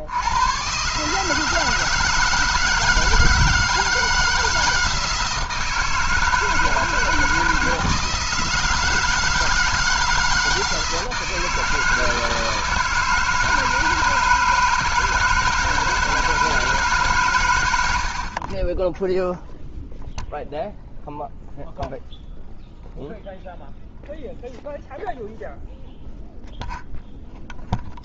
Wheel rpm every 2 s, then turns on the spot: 130, 160, 160, 160, 160, 160, 170, 160, 160, 20, 0, 0, 0, 0.
none